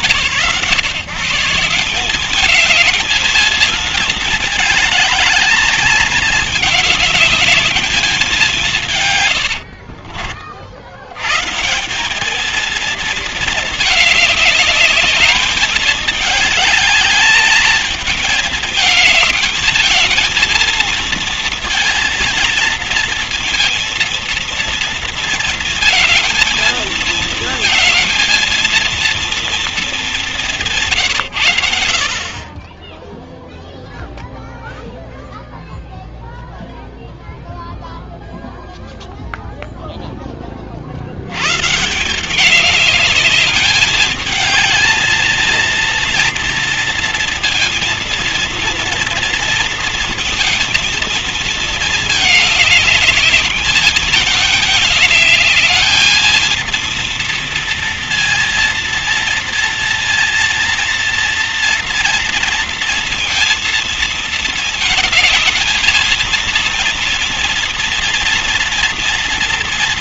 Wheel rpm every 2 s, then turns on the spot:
160, 220, 210, 200, 130, 90, 230, 210, 210, 220, 230, 230, 230, 220, 230, 150, 10, 0, 0, 0, 40, 200, 220, 230, 230, 230, 210, 210, 230, 230, 230, 230, 220, 230, 230.
8-10